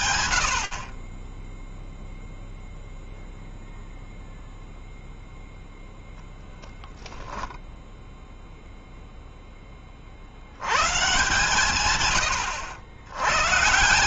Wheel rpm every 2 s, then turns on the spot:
0, 0, 0, 0, 20, 140, 140.
none